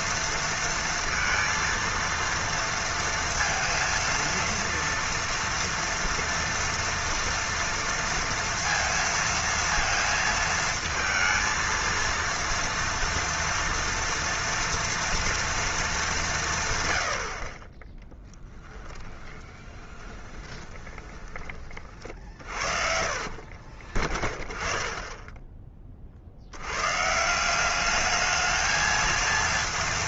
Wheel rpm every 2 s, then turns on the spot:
230, 230, 230, 230, 230, 220, 230, 230, 140, 10, 10, 50, 20, 100, 220.
18-24